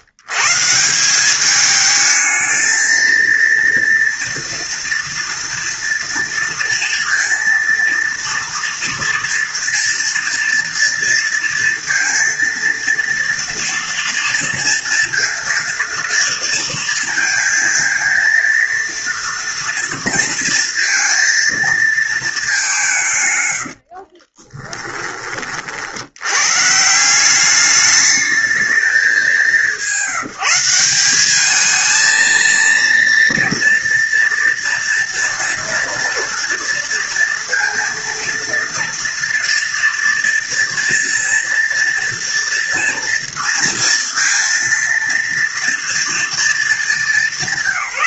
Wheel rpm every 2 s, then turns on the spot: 170, 230, 230, 230, 230, 230, 230, 230, 230, 230, 230, 160, 20, 160, 200, 200, 230, 240, 230, 230, 230, 230, 230, 230.
none